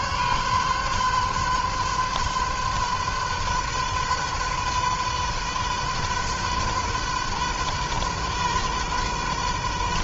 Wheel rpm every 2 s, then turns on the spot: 130, 130, 130, 130, 130.
none